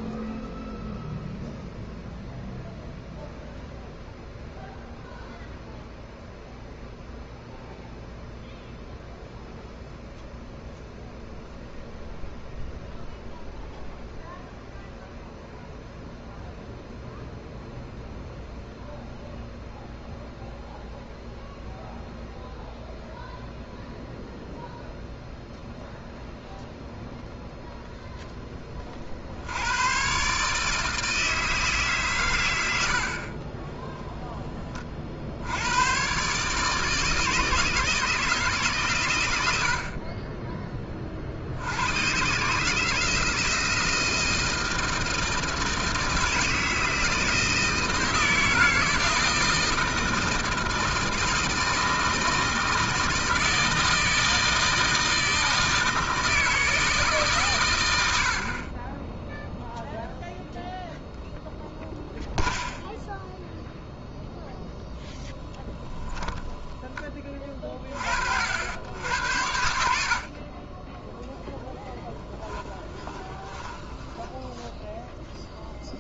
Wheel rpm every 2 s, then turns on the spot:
0, 0, 0, 0, 0, 0, 0, 0, 0, 0, 0, 0, 0, 0, 20, 150, 90, 30, 150, 140, 20, 150, 160, 160, 160, 160, 160, 160, 160, 30, 0, 0, 0, 20, 80, 20, 10, 0.
none